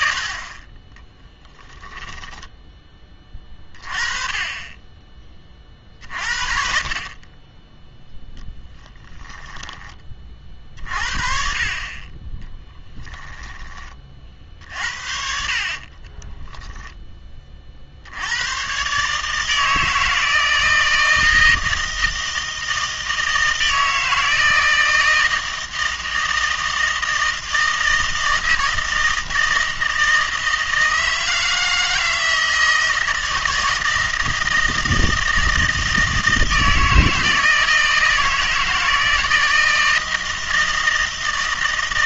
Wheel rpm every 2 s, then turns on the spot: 30, 10, 20, 50, 10, 40, 10, 70, 10, 120, 160, 160, 160, 160, 160, 160, 160, 160, 160, 160, 160.
8-10 12-14